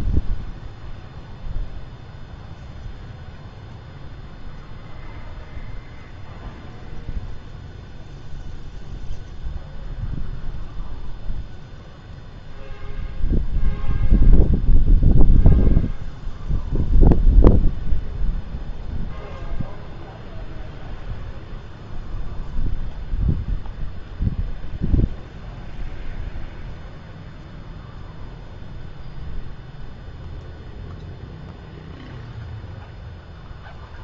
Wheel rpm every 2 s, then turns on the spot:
0, 0, 0, 0, 0, 0, 0, 0, 0, 0, 0, 0, 0, 0, 0, 0, 0.
none